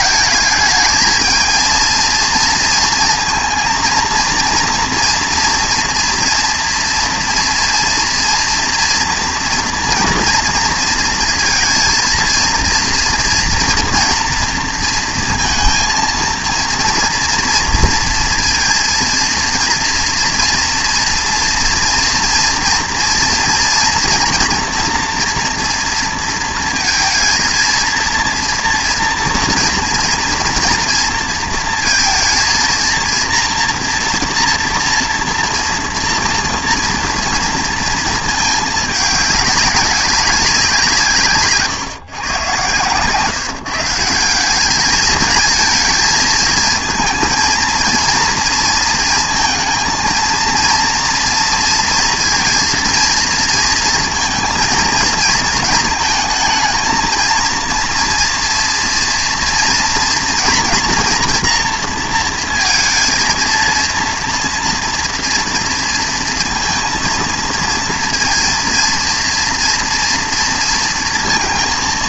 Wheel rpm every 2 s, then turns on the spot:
210, 230, 230, 230, 240, 230, 230, 230, 230, 230, 230, 230, 230, 230, 230, 230, 230, 240, 230, 210, 180, 130, 200, 220, 230, 230, 230, 230, 230, 230, 230, 230, 230, 230, 230, 230.
42-44